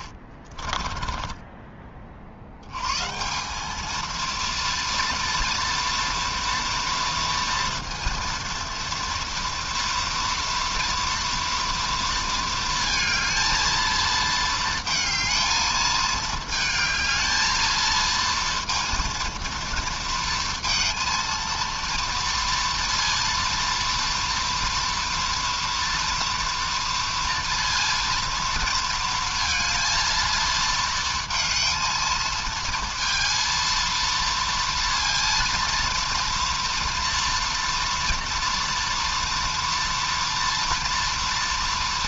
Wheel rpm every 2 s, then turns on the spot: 30, 70, 230, 230, 230, 230, 230, 220, 220, 230, 230, 230, 230, 230, 230, 230, 220, 230, 230, 240, 230.
0-2